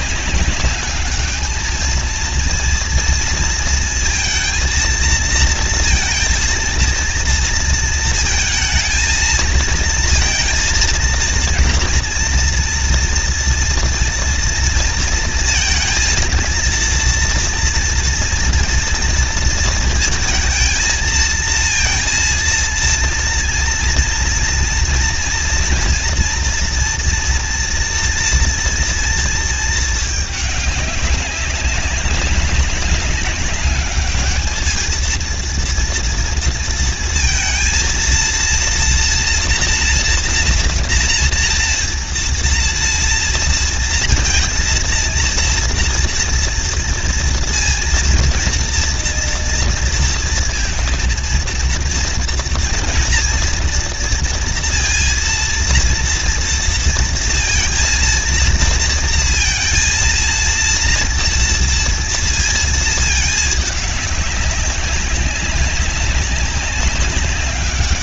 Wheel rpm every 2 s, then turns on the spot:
200, 230, 230, 230, 230, 230, 230, 230, 230, 230, 220, 230, 230, 230, 230, 200, 200, 210, 230, 230, 240, 230, 230, 230, 240, 230, 230, 230, 230, 230, 230, 230, 200, 190.
none